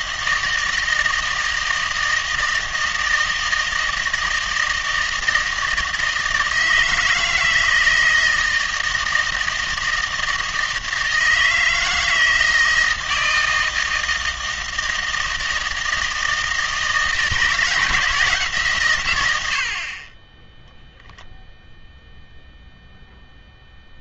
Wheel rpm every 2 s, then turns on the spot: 160, 160, 160, 160, 160, 160, 160, 160, 160, 140, 10, 0.
none